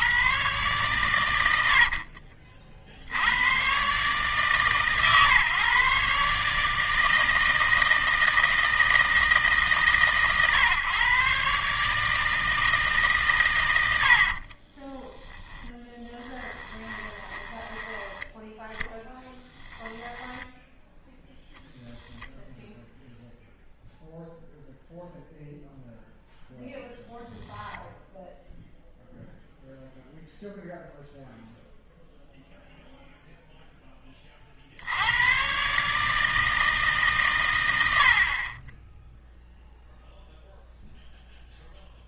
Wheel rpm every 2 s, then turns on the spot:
120, 60, 140, 150, 160, 130, 160, 30, 20, 10, 10, 0, 0, 10, 0, 0, 0, 60, 160, 20, 0.
14-18